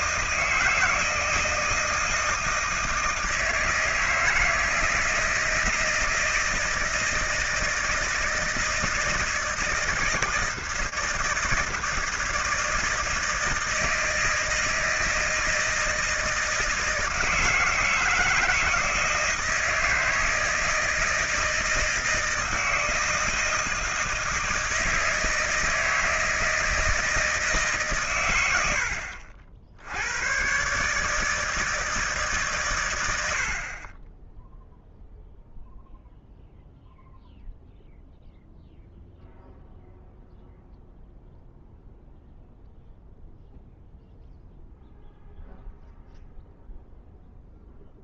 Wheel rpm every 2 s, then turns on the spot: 160, 160, 160, 160, 160, 160, 160, 160, 160, 160, 160, 160, 160, 160, 110, 120, 140, 10, 0, 0, 0, 0, 0, 0.
none